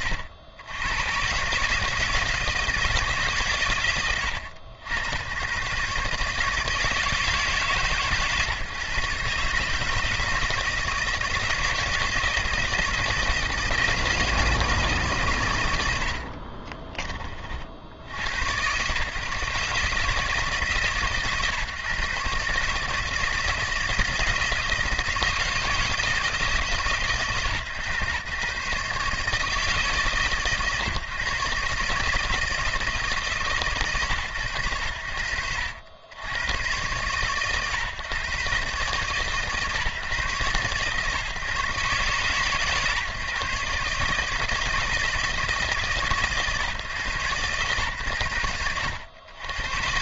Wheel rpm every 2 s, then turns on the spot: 90, 170, 90, 160, 140, 160, 160, 160, 30, 120, 150, 150, 160, 150, 130, 130, 160, 70, 100, 130, 130, 140, 160, 140, 80.
16-18